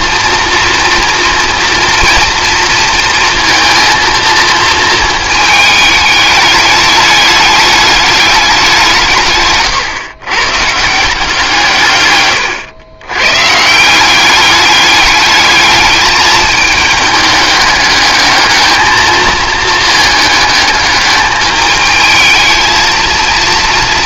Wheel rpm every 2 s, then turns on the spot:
230, 230, 230, 210, 180, 150, 110, 200, 220, 220, 210, 220.
none